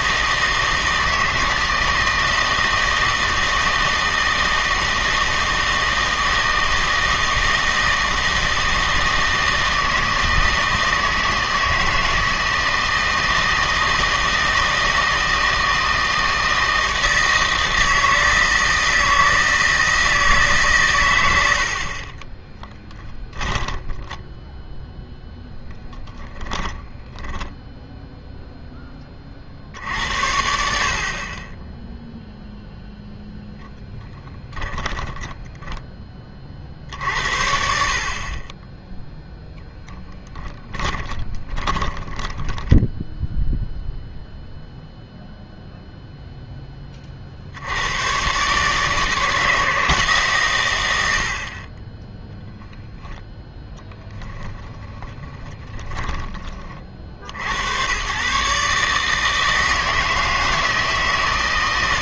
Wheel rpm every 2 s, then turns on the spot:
160, 160, 160, 160, 160, 160, 160, 160, 160, 160, 130, 10, 0, 10, 10, 60, 0, 10, 50, 10, 20, 10, 0, 20, 140, 110, 0, 30, 30, 140, 160.
22-24 26-28 34-36 40-44 54-56